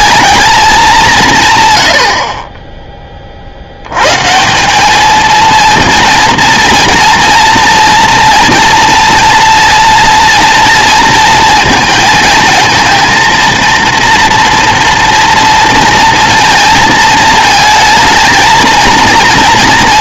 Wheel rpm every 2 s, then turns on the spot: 210, 30, 170, 230, 230, 230, 220, 230, 220, 230.
none